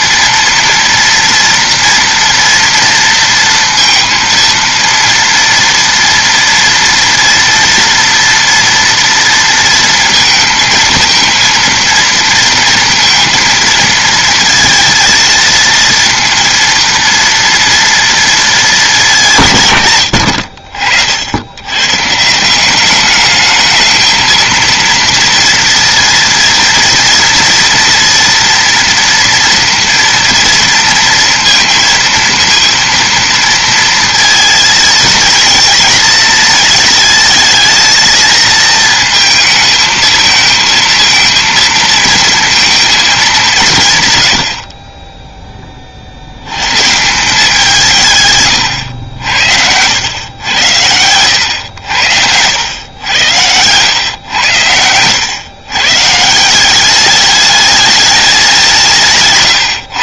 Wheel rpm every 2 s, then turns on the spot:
230, 230, 230, 230, 230, 230, 230, 230, 230, 210, 50, 180, 230, 230, 230, 230, 230, 230, 230, 220, 220, 230, 40, 110, 110, 100, 100, 100, 180, 190.
48-52